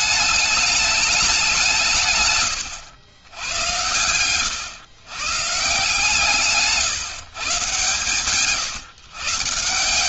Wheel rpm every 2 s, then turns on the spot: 210, 120, 120, 150, 140.
2-4